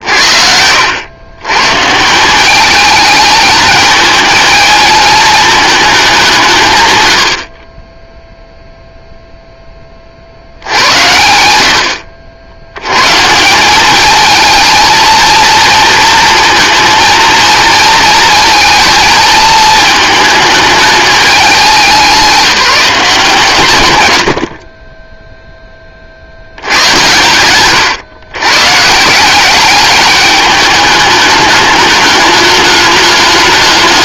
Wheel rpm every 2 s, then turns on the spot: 80, 210, 220, 130, 0, 110, 100, 220, 230, 230, 220, 190, 30, 100, 140, 210, 210.
none